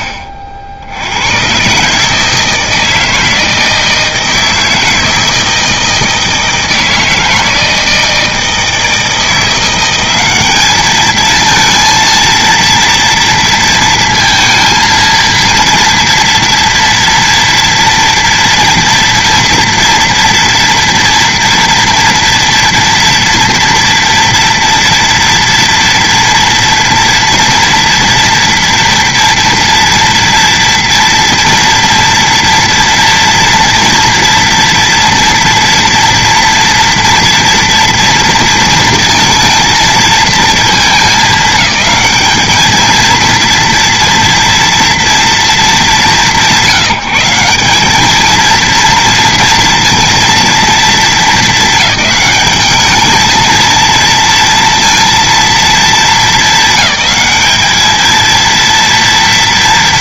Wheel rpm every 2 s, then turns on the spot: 70, 160, 160, 160, 160, 220, 230, 230, 240, 230, 230, 230, 230, 230, 240, 230, 230, 230, 230, 230, 220, 220, 230, 170, 230, 220, 210, 230, 220, 230.
none